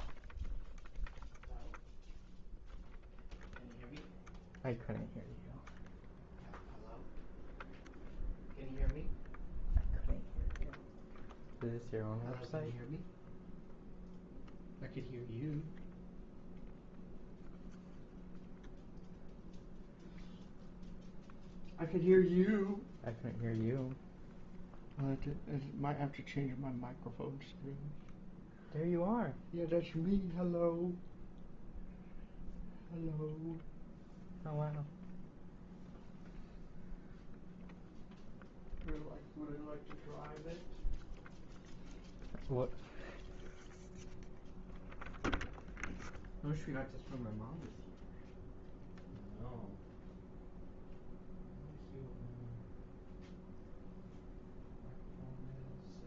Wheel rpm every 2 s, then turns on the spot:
0, 0, 0, 0, 0, 0, 0, 0, 0, 0, 0, 0, 0, 0, 0, 0, 0, 0, 0, 0, 0, 0, 0, 0, 0, 0, 0, 0.
none